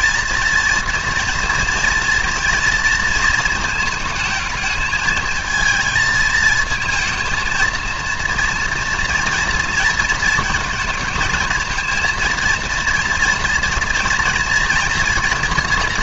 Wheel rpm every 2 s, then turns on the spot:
230, 230, 220, 220, 230, 220, 230, 230.
none